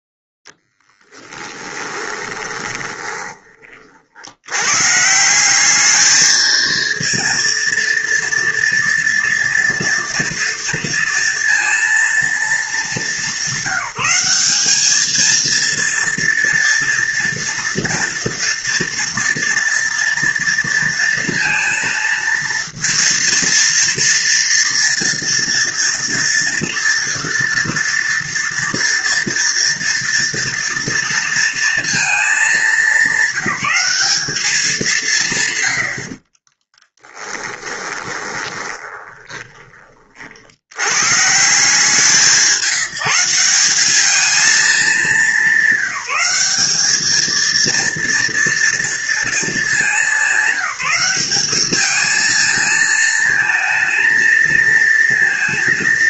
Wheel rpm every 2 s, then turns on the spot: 10, 20, 100, 220, 230, 230, 220, 200, 230, 230, 230, 230, 230, 230, 230, 230, 210, 190, 30, 20, 80, 170, 220, 200, 230, 190, 220, 230.
2-4 36-40